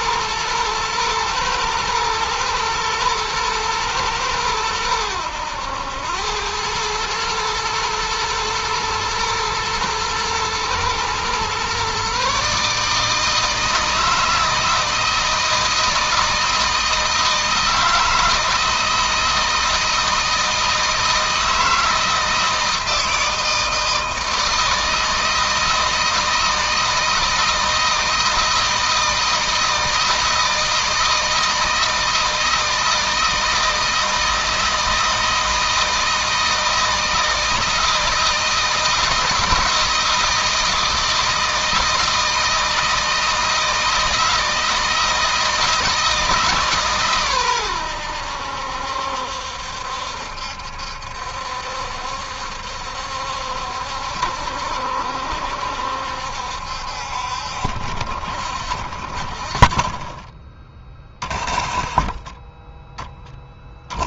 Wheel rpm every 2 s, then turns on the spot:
110, 110, 100, 110, 110, 120, 150, 160, 160, 160, 160, 160, 160, 160, 160, 160, 160, 160, 160, 170, 160, 160, 160, 130, 70, 70, 70, 70, 60, 50, 20, 10.
none